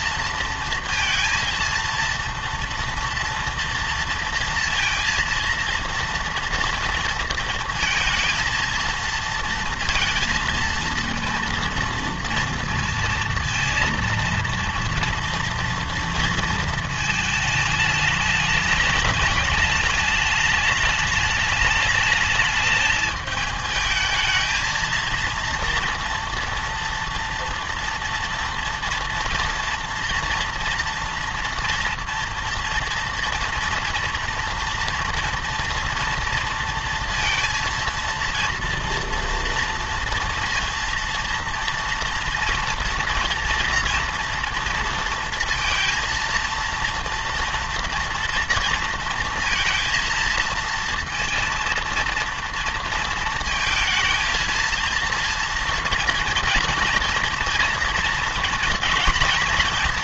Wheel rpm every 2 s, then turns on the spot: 230, 230, 230, 230, 230, 230, 230, 230, 230, 210, 210, 210, 220, 240, 230, 230, 230, 230, 230, 230, 230, 240, 230, 230, 230, 230, 230, 230, 230, 230.
none